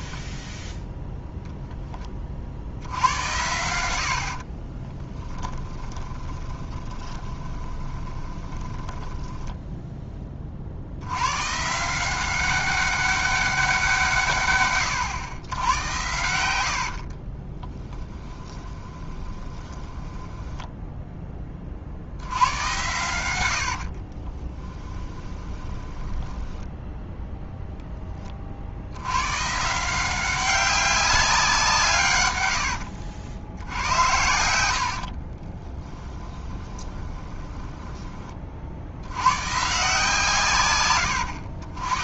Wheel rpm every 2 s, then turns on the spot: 0, 70, 40, 20, 20, 50, 190, 110, 70, 20, 10, 110, 20, 10, 70, 190, 80, 80, 20, 60, 110.
4-10 16-22 24-28 32-38